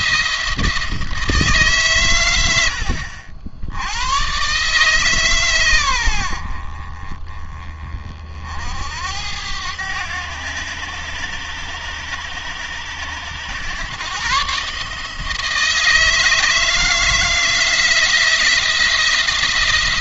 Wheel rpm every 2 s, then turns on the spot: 160, 80, 140, 60, 60, 100, 100, 150, 160, 170.
none